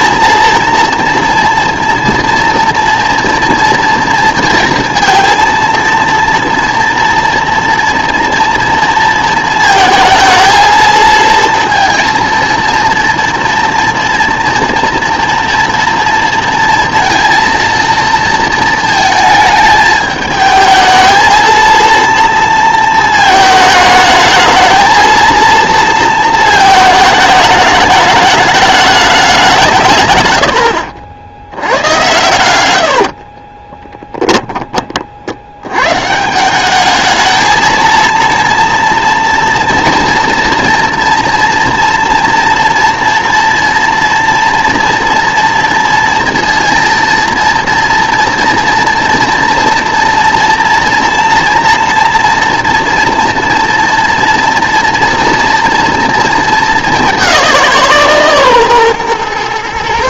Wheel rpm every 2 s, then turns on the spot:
230, 230, 230, 230, 230, 220, 230, 240, 230, 220, 220, 230, 220, 220, 210, 80, 80, 20, 190, 230, 230, 230, 230, 230, 230, 240, 230, 240, 220, 140.
32-34